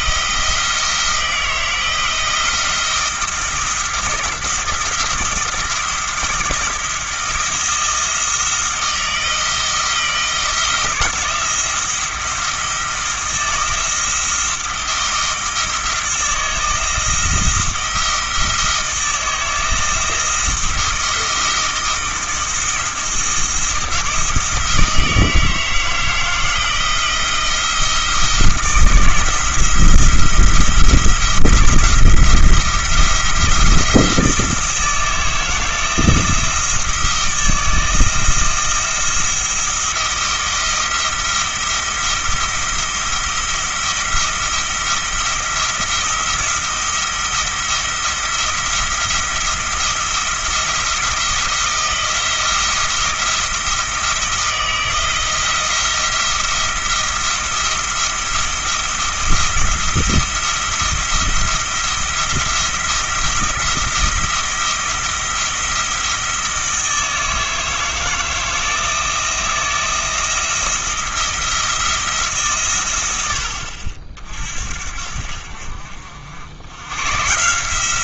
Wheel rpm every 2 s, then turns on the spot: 160, 170, 170, 170, 160, 160, 170, 170, 170, 160, 170, 170, 160, 160, 170, 170, 170, 160, 170, 170, 170, 170, 170, 170, 170, 170, 170, 170, 170, 170, 170, 170, 170, 160, 160, 170, 120, 60, 110.
none